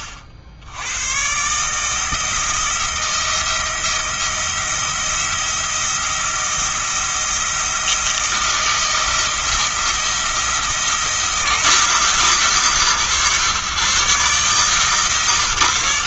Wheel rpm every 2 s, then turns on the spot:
70, 170, 170, 170, 170, 170, 130, 150.
none